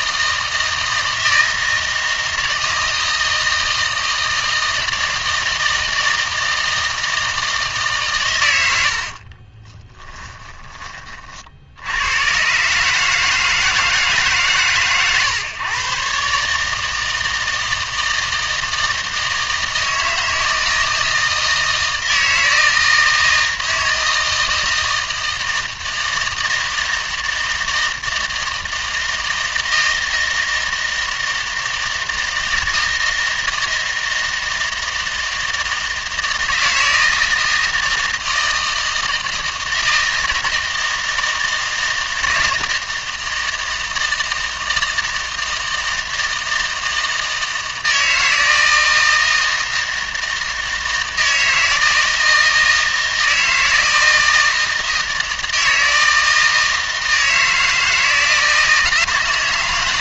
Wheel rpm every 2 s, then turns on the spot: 160, 160, 160, 160, 90, 20, 140, 140, 150, 160, 160, 160, 160, 160, 160, 160, 160, 160, 160, 160, 160, 160, 160, 160, 160, 160, 160, 160, 160, 160.
none